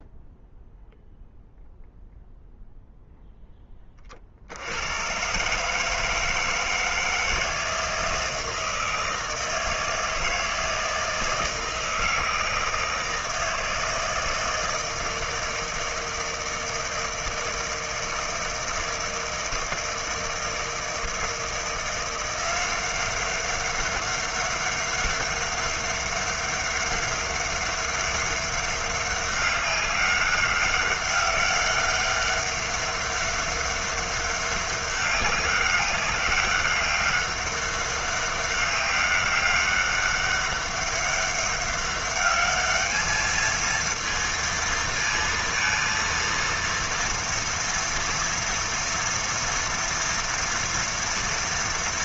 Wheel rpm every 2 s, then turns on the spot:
0, 0, 110, 160, 160, 160, 160, 160, 160, 160, 160, 190, 200, 200, 200, 200, 200, 200, 200, 200, 200, 210, 230, 230, 230, 220.
none